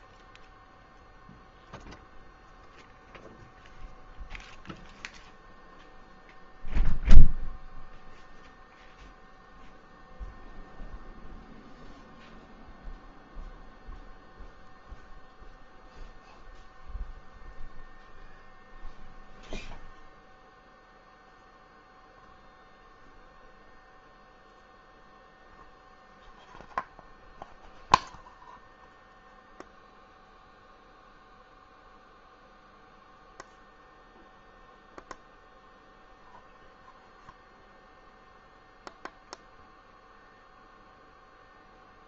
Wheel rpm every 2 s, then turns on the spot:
0, 0, 0, 0, 0, 0, 0, 0, 0, 0, 0, 0, 0, 0, 0, 0, 0, 0, 0, 0, 0.
none